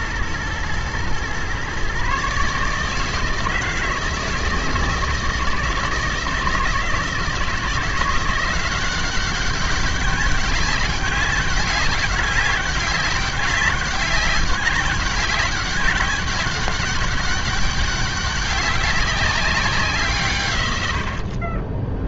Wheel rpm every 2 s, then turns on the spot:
110, 150, 160, 160, 180, 200, 200, 200, 190, 190, 130.
none